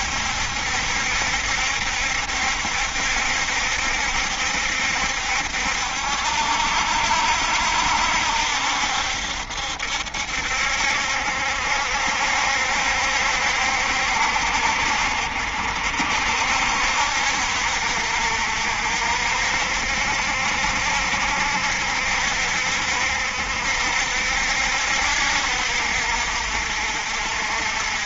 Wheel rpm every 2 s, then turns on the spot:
70, 70, 70, 70, 70, 70, 70, 60, 60, 60, 70, 70, 70, 60.
none